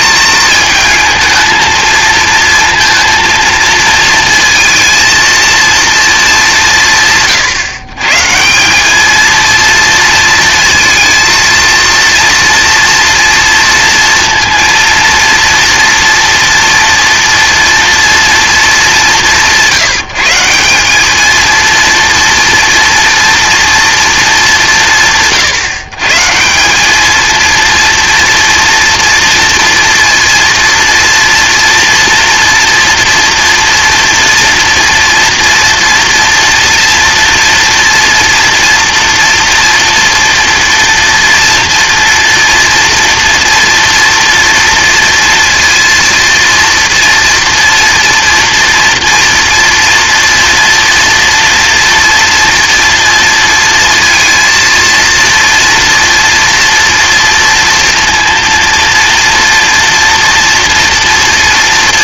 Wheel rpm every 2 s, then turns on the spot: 220, 230, 230, 190, 170, 230, 230, 230, 240, 220, 180, 240, 180, 180, 230, 230, 240, 230, 230, 230, 230, 230, 230, 230, 230, 230, 230, 230, 230, 230, 230.
none